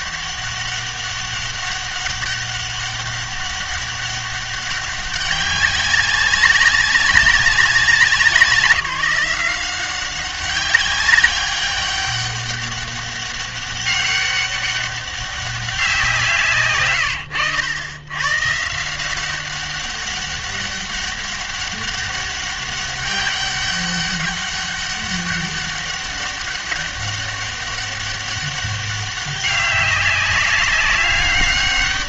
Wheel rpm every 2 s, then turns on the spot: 200, 200, 200, 200, 170, 190, 200, 200, 150, 150, 200, 200, 200, 200, 200, 200.
none